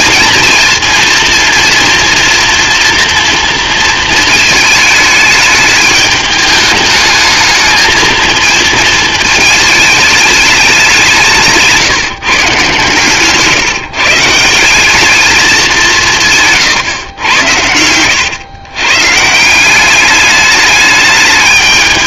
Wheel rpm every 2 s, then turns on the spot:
230, 240, 220, 210, 220, 190, 130, 180, 130, 130, 210.
none